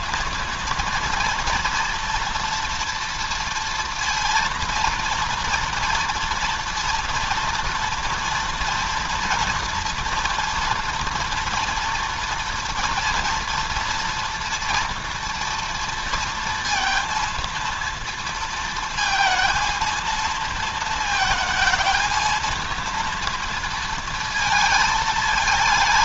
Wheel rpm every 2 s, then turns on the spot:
230, 230, 230, 230, 230, 230, 230, 230, 230, 230, 220, 230, 230.
none